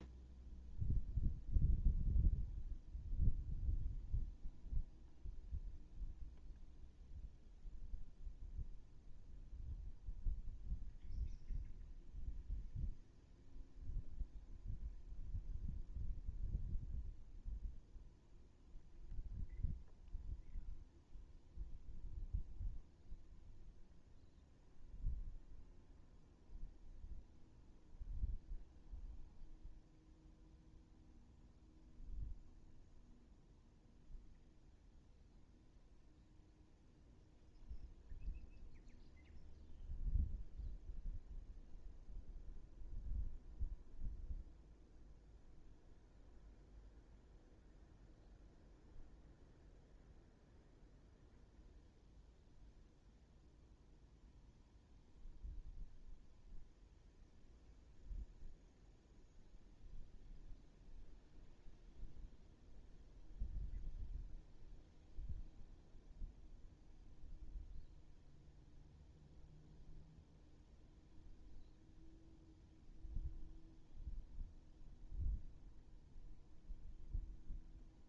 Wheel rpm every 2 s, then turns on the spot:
0, 0, 0, 0, 0, 0, 0, 0, 0, 0, 0, 0, 0, 0, 0, 0, 0, 0, 0, 0, 0, 0, 0, 0, 0, 0, 0, 0, 0, 0, 0, 0, 0, 0, 0, 0, 0, 0, 0.
none